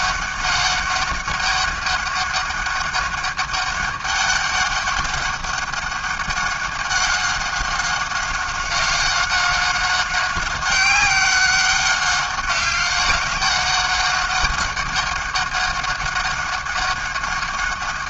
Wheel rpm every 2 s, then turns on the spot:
200, 200, 200, 190, 190, 190, 190, 200, 200.
none